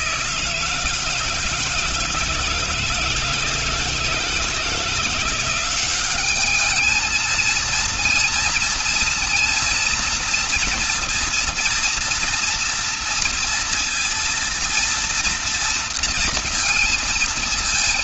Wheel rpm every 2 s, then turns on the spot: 160, 160, 160, 210, 230, 230, 230, 230, 230.
none